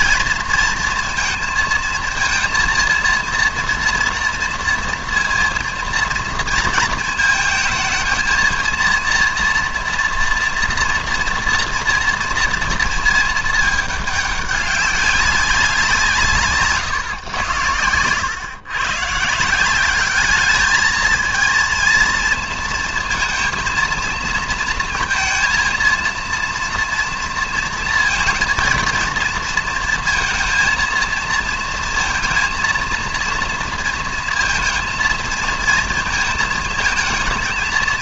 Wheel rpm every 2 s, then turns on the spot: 230, 230, 230, 230, 230, 230, 230, 200, 140, 120, 210, 230, 230, 230, 230, 230, 230, 230, 220.
16-18